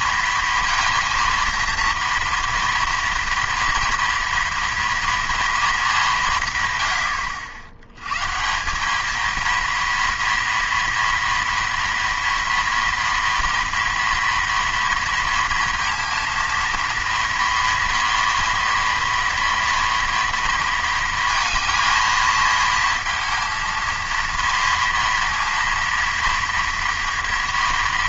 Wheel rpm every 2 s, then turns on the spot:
230, 230, 230, 140, 170, 230, 230, 230, 230, 230, 230, 230, 230, 230.
none